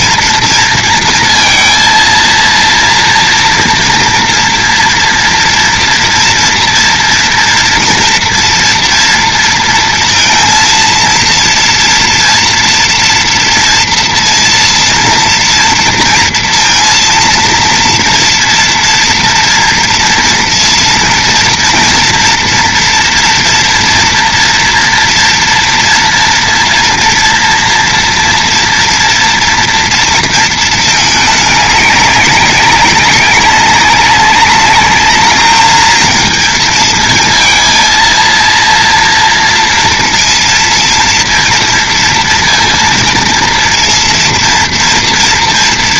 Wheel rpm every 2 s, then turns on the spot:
230, 230, 230, 230, 230, 230, 230, 230, 230, 230, 230, 230, 230, 230, 230, 220, 200, 200, 220, 230, 230, 230, 230.
none